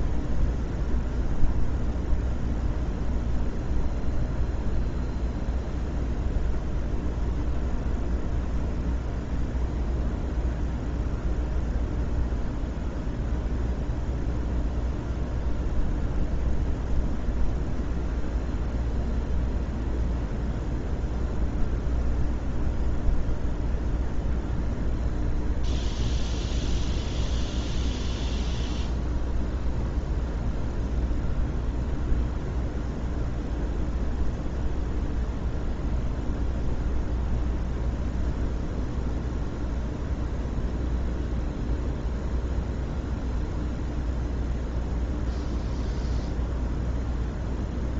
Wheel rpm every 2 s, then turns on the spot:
0, 0, 0, 0, 0, 0, 0, 0, 0, 0, 0, 0, 0, 0, 0, 0, 0, 0, 0, 0, 0, 0, 0, 0.
none